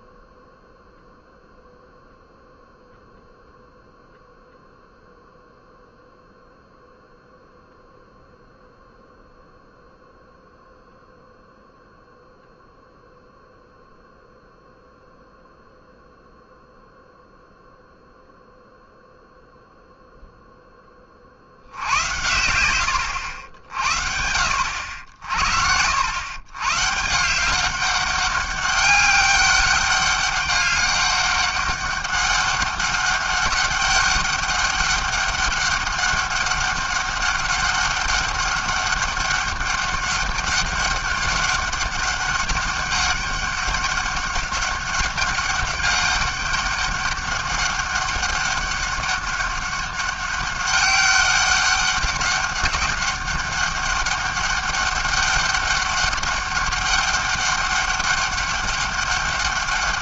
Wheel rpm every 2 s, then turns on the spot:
0, 0, 0, 0, 0, 0, 0, 0, 0, 0, 10, 90, 70, 130, 190, 200, 200, 200, 200, 200, 200, 200, 200, 200, 200, 190, 200, 200, 200, 200.
none